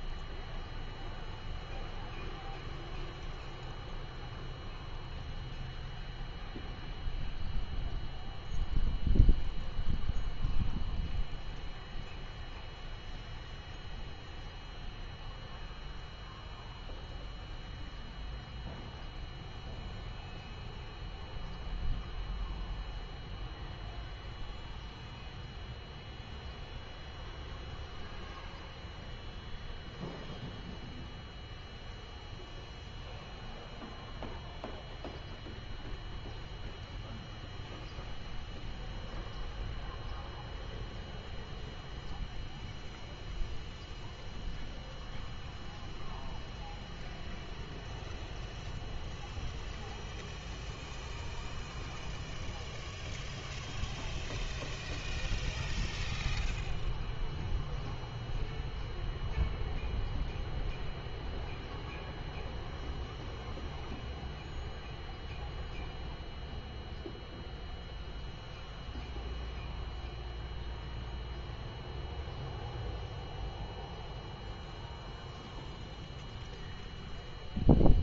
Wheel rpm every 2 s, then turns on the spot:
0, 0, 0, 0, 0, 0, 0, 0, 0, 0, 0, 0, 0, 0, 0, 0, 0, 0, 0, 0, 0, 0, 0, 0, 0, 0, 0, 0, 0, 0, 0, 0, 0, 0, 0, 0, 0, 0, 0.
none